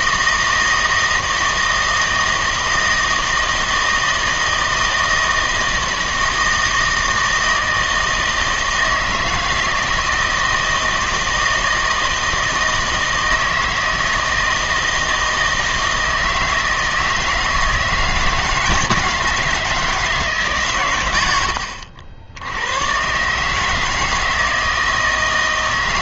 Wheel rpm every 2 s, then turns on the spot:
160, 160, 160, 160, 160, 160, 160, 160, 160, 160, 140, 90, 160.
none